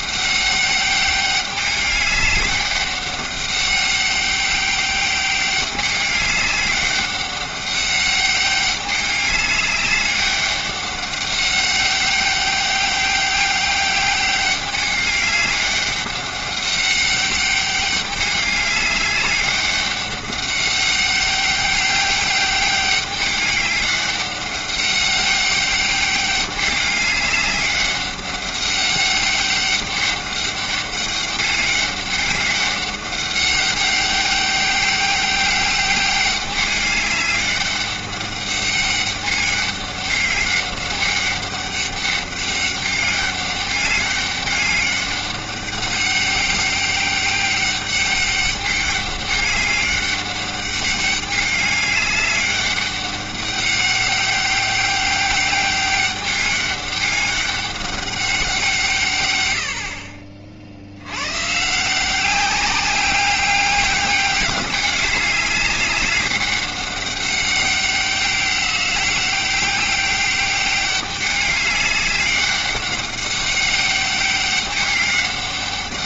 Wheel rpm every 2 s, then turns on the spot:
200, 200, 200, 200, 200, 200, 200, 200, 200, 200, 190, 200, 200, 200, 200, 200, 200, 200, 200, 200, 200, 200, 200, 200, 200, 200, 200, 200, 200, 160, 70, 190, 200, 200, 200, 200, 200, 200.
none